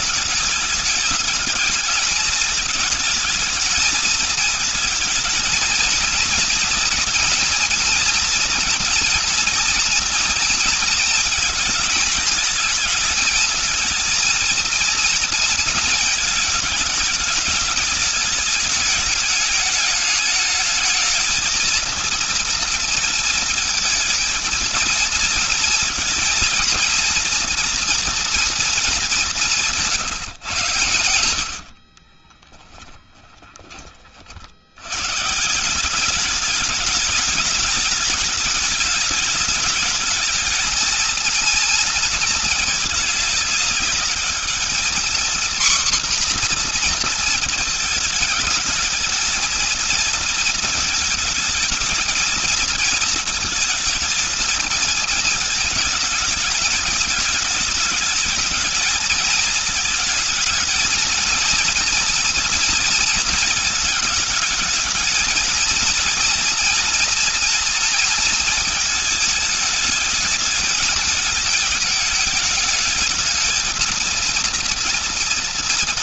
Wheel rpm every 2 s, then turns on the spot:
210, 220, 220, 230, 240, 230, 220, 230, 220, 210, 220, 230, 230, 230, 210, 100, 10, 90, 210, 210, 220, 220, 220, 230, 220, 220, 220, 220, 210, 220, 230, 230, 220, 230, 220, 220, 220, 230.
30-34